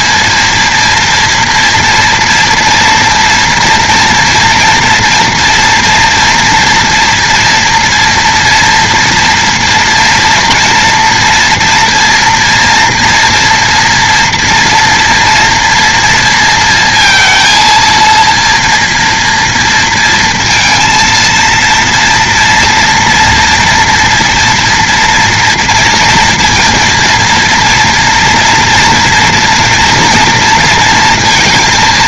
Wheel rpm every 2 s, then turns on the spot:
230, 240, 230, 230, 230, 230, 230, 230, 230, 230, 230, 230, 230, 230, 230, 230.
none